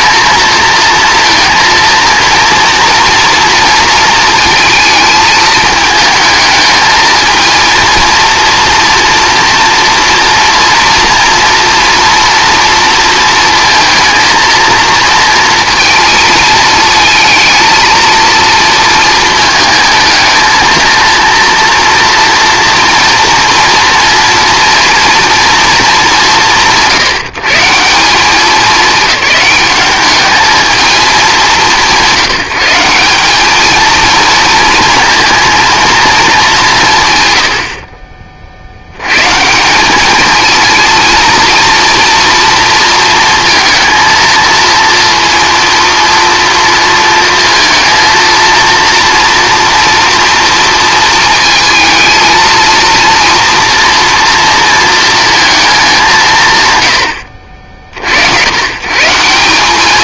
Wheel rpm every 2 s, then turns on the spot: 230, 230, 230, 220, 240, 230, 230, 230, 220, 220, 220, 230, 230, 180, 210, 220, 180, 230, 190, 50, 220, 230, 230, 230, 230, 230, 230, 230, 140, 110.
none